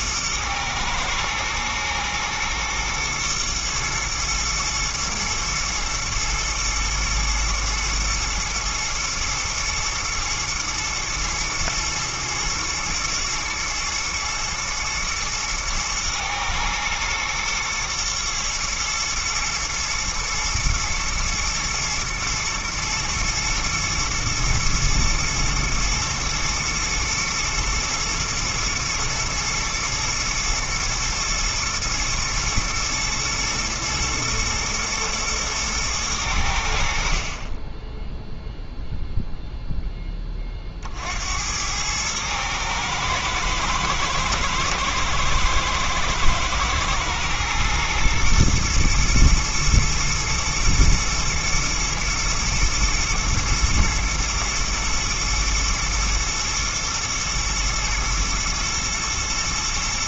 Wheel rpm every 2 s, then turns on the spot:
110, 110, 110, 110, 120, 110, 120, 110, 110, 110, 110, 120, 110, 110, 110, 120, 110, 120, 70, 0, 40, 110, 110, 110, 120, 120, 110, 120, 110, 110.
none